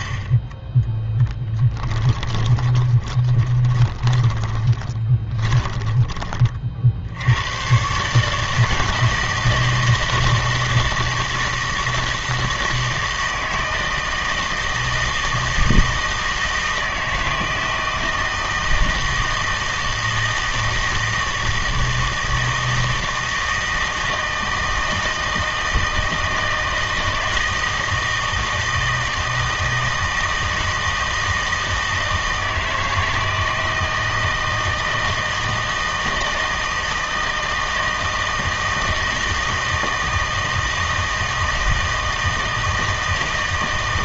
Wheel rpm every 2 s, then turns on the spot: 10, 20, 20, 50, 160, 160, 160, 160, 160, 160, 160, 160, 160, 160, 160, 160, 160, 160, 160, 160, 160, 160.
2-6